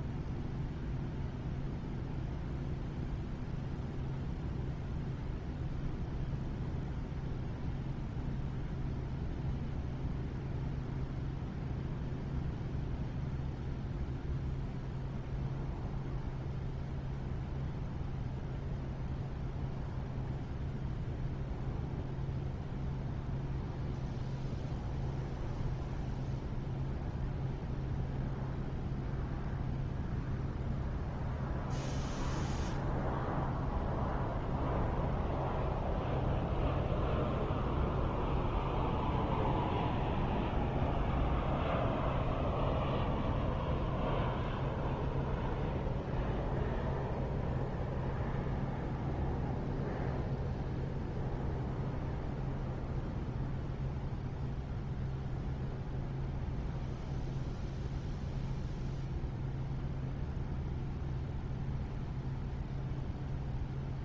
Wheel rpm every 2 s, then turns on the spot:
0, 0, 0, 0, 0, 0, 0, 0, 0, 0, 0, 0, 0, 0, 0, 0, 0, 0, 0, 0, 0, 0, 0, 0, 0, 0, 0, 0, 0, 0, 0, 0.
none